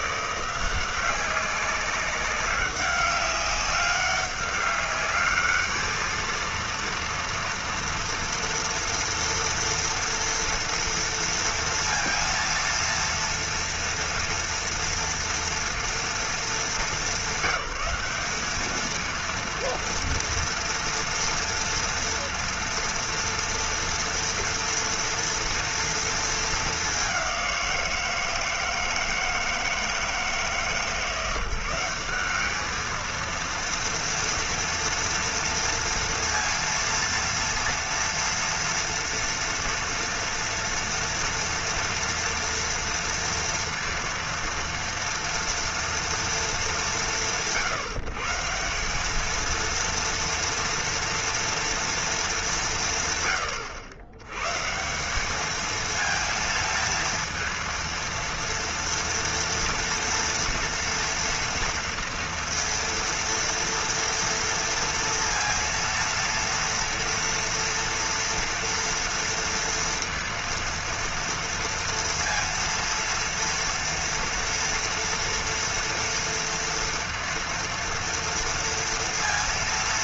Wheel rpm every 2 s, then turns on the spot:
180, 190, 200, 230, 240, 230, 230, 230, 210, 210, 230, 230, 230, 210, 160, 160, 210, 230, 230, 230, 230, 230, 230, 210, 180, 230, 180, 150, 220, 230, 230, 230, 230, 230, 230, 230, 230, 240, 230, 230.
none